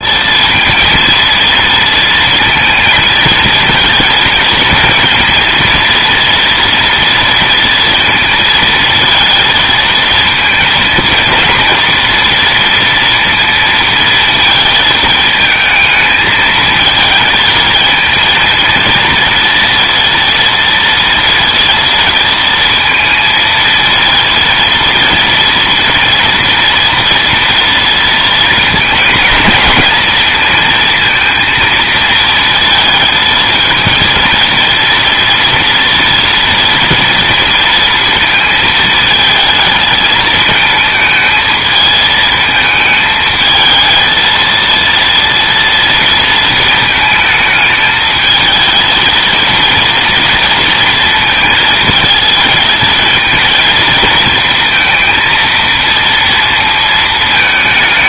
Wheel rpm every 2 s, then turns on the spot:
220, 230, 230, 230, 230, 230, 230, 220, 220, 230, 230, 230, 230, 230, 220, 230, 220, 230, 230, 220, 220, 220, 230, 220, 220, 230, 220, 230, 230.
none